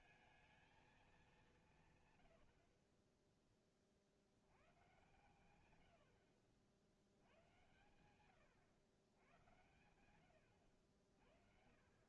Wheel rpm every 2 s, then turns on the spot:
220, 40, 110, 60, 110, 70.
none